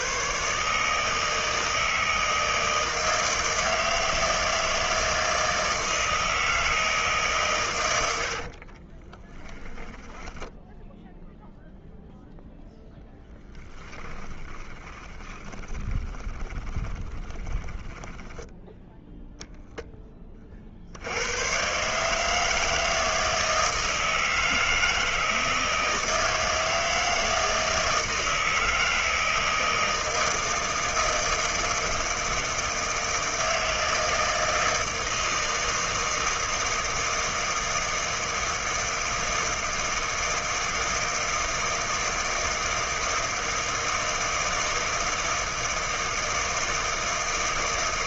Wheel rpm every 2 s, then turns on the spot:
140, 160, 160, 160, 70, 0, 0, 20, 20, 10, 50, 160, 160, 160, 160, 160, 160, 160, 160, 160, 160, 160, 160, 160.
8-10 14-18